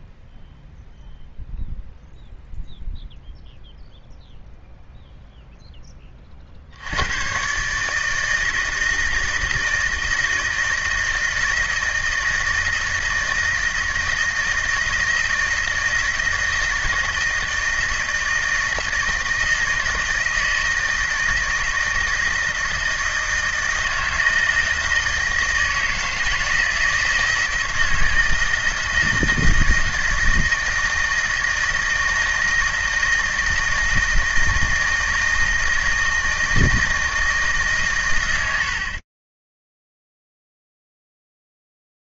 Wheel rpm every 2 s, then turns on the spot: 0, 0, 0, 70, 160, 160, 170, 160, 160, 160, 160, 160, 160, 170, 160, 160, 160, 160, 160, 80, 0.
none